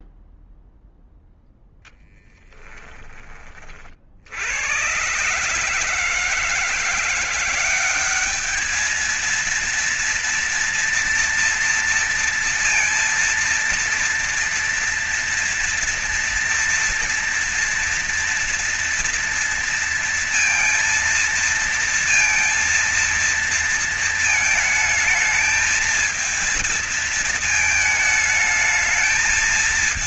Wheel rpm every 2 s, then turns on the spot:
0, 10, 70, 150, 200, 230, 230, 230, 230, 230, 230, 230, 220, 220, 220.
2-4